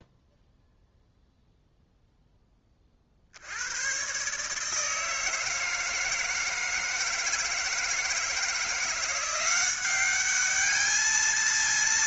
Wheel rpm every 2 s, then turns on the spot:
0, 40, 160, 160, 170, 210.
none